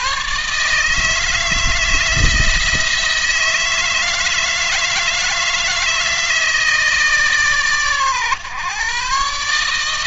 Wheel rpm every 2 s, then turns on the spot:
140, 160, 160, 160, 130.
none